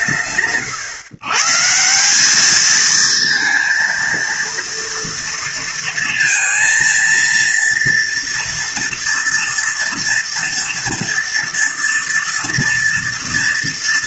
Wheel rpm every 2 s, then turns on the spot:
150, 230, 230, 230, 230, 230, 230.
none